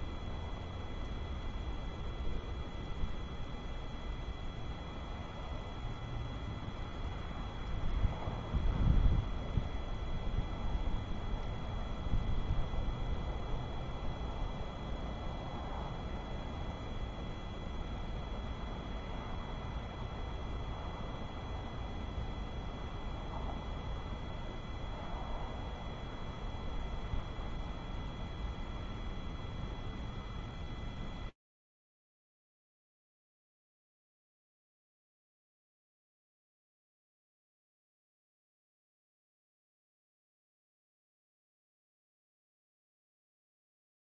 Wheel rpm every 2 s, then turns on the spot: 0, 0, 0, 0, 0, 0, 0, 0, 0, 0, 0, 0, 0, 0, 0, 0, 0, 0, 0, 0, 0, 0.
none